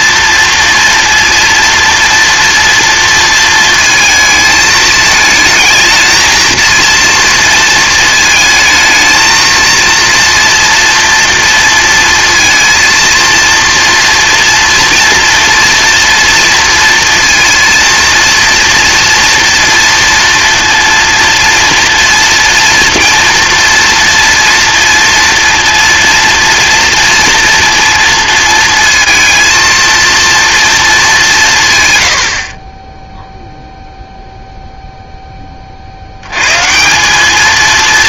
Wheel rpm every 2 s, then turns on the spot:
230, 230, 220, 230, 220, 230, 230, 230, 230, 230, 230, 230, 230, 230, 230, 230, 30, 0, 150.
none